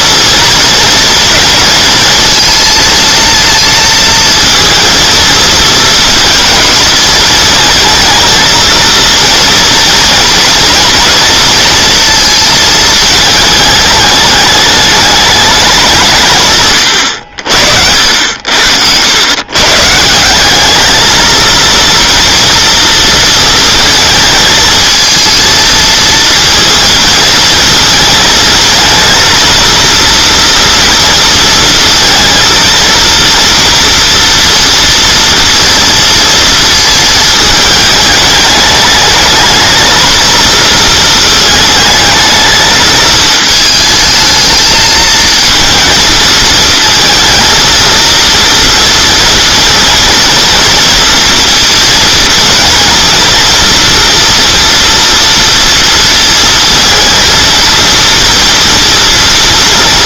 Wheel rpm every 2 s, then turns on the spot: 240, 230, 230, 220, 230, 230, 220, 210, 130, 80, 200, 230, 220, 230, 220, 230, 230, 230, 230, 210, 230, 220, 220, 220, 230, 230, 230, 230, 230, 230.
none